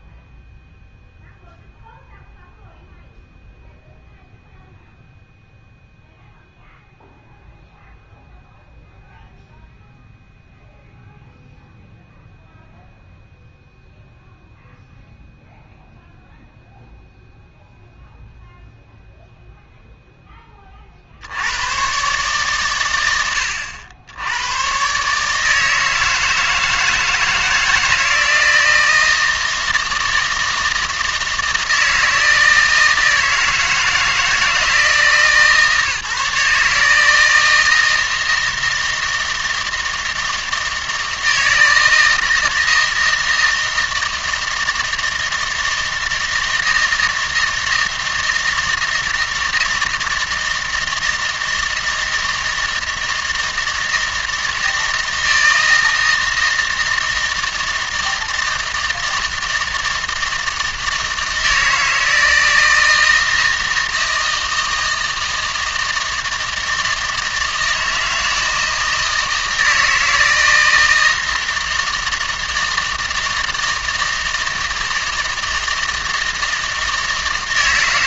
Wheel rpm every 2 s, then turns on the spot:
0, 0, 0, 0, 0, 0, 0, 0, 0, 0, 40, 130, 110, 160, 160, 160, 160, 160, 150, 160, 160, 160, 160, 160, 160, 160, 160, 160, 160, 160, 160, 160, 160, 160, 160, 160, 160, 160, 160.
none